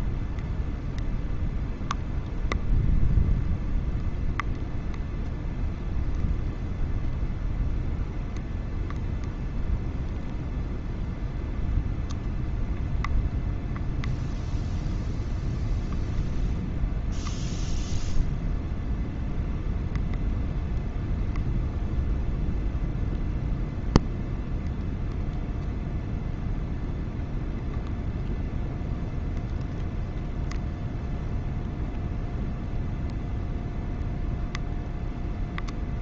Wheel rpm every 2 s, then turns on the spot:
0, 0, 0, 0, 0, 0, 0, 0, 0, 0, 0, 0, 0, 0, 0, 0, 0, 0.
none